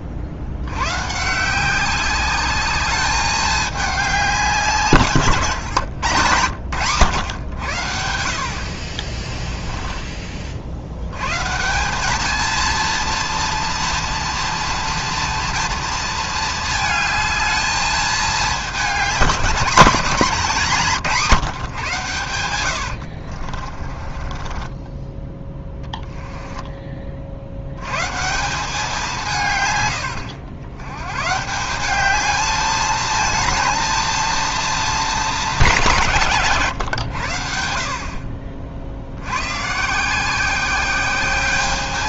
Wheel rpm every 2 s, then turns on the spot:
100, 210, 160, 110, 50, 50, 230, 230, 220, 210, 180, 90, 20, 20, 180, 100, 220, 230, 140, 60, 190.
20-26